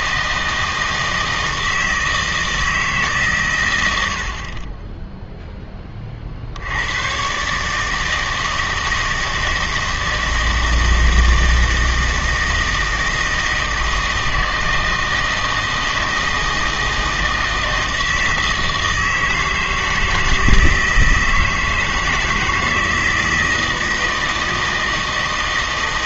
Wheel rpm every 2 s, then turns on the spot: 160, 160, 20, 100, 160, 160, 160, 160, 160, 160, 160, 160, 160.
none